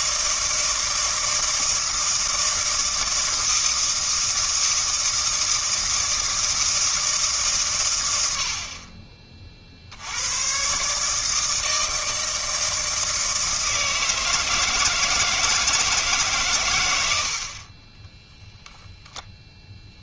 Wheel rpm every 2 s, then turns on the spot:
160, 160, 160, 160, 50, 130, 160, 160, 110, 0.
none